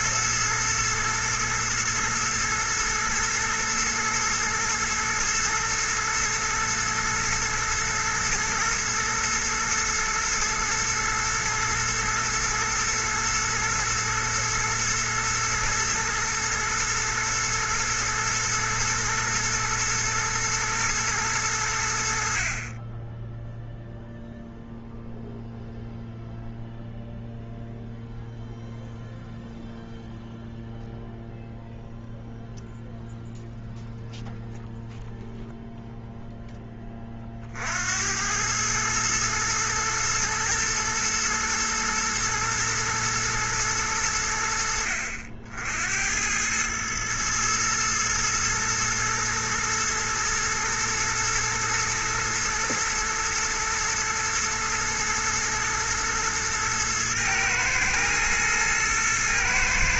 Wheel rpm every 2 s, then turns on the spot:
110, 120, 120, 110, 120, 110, 110, 110, 110, 120, 110, 40, 0, 0, 0, 0, 0, 0, 10, 100, 120, 110, 60, 100, 120, 120, 110, 110, 120, 120.
none